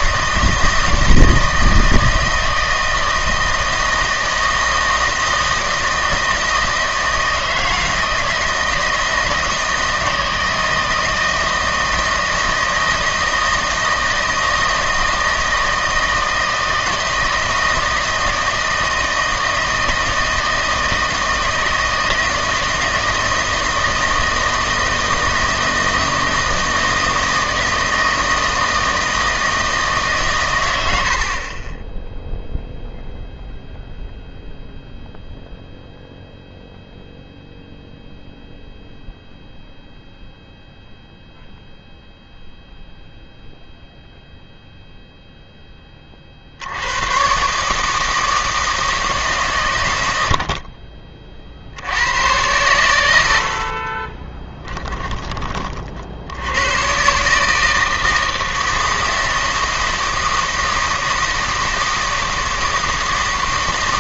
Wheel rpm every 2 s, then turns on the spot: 160, 160, 160, 160, 160, 160, 160, 160, 160, 160, 160, 160, 160, 160, 160, 100, 0, 0, 0, 0, 0, 0, 0, 70, 160, 50, 110, 20, 100, 160, 160, 160.
54-56